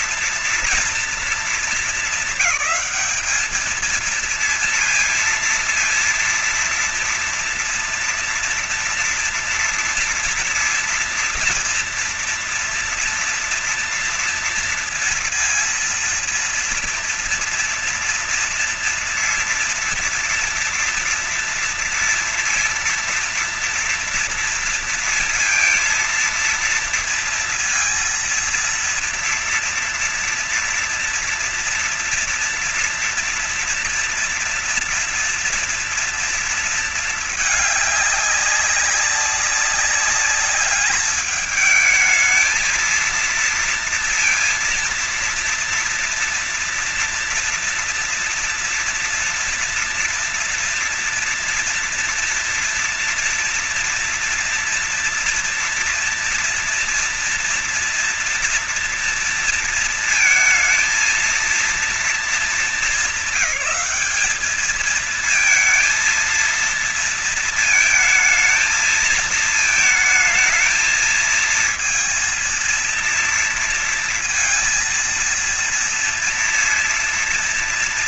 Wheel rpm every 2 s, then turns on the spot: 230, 220, 230, 230, 230, 240, 230, 230, 230, 230, 230, 230, 230, 230, 230, 230, 230, 230, 230, 200, 210, 220, 230, 230, 230, 230, 230, 230, 230, 230, 220, 210, 200, 230, 220, 220, 230, 230, 230.
none